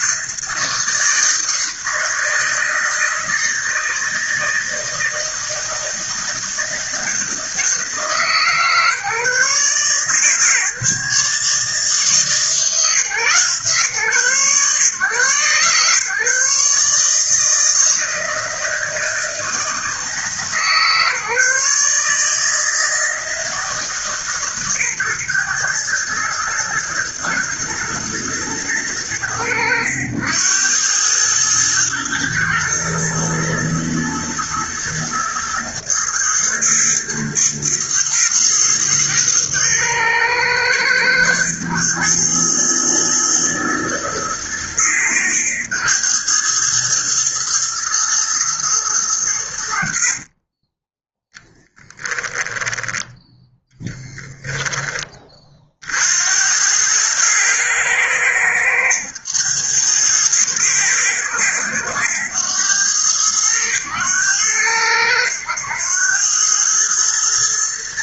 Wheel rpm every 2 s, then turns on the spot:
160, 160, 160, 160, 150, 150, 140, 130, 150, 160, 150, 160, 130, 110, 100, 100, 120, 120, 110, 110, 110, 110, 110, 110, 110, 20, 10, 20, 100, 100, 110, 100, 90, 110.
50-52